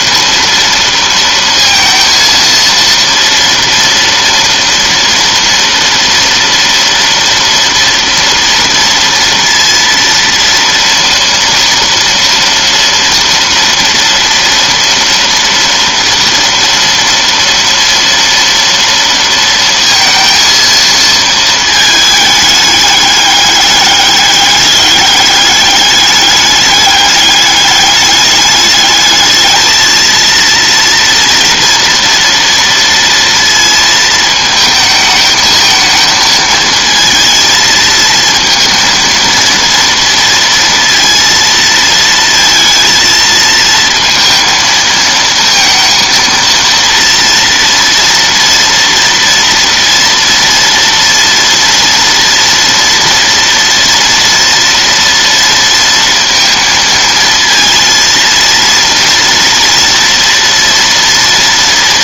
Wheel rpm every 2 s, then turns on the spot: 230, 230, 230, 230, 230, 230, 230, 230, 230, 230, 230, 210, 200, 200, 210, 230, 230, 220, 220, 230, 230, 230, 230, 230, 230, 230, 230, 230, 230, 230, 230.
none